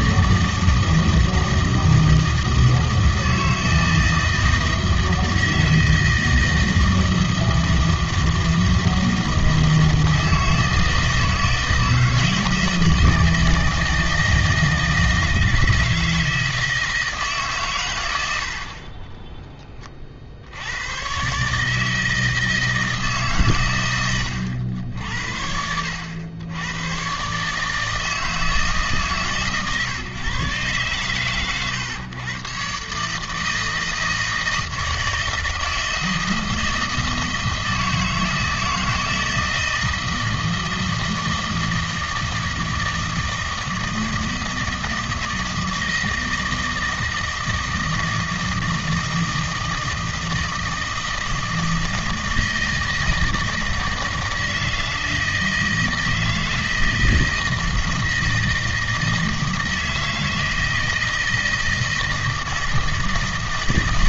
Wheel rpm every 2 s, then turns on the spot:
160, 160, 160, 160, 160, 160, 160, 160, 160, 50, 100, 160, 80, 110, 150, 130, 140, 160, 160, 160, 160, 160, 160, 160, 160, 160, 160, 160, 160, 160, 160, 160.
none